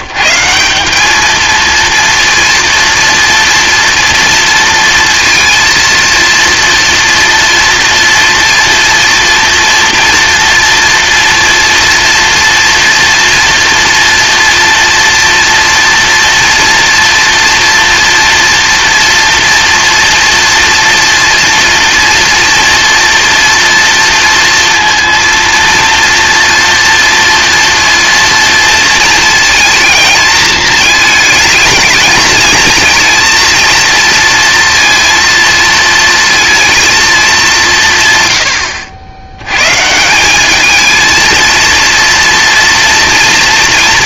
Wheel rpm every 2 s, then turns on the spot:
190, 230, 230, 230, 230, 230, 230, 230, 230, 230, 230, 240, 230, 230, 230, 220, 230, 230, 220, 90, 220, 230.
none